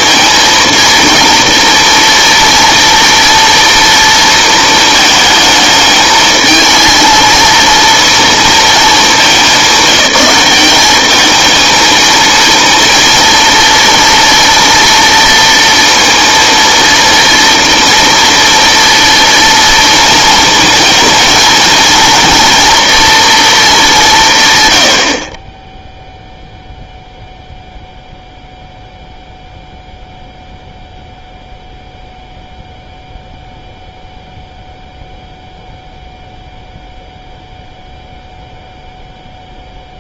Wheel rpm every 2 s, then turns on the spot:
230, 240, 230, 220, 230, 190, 230, 230, 230, 230, 230, 240, 130, 0, 0, 0, 0, 0, 0, 0.
none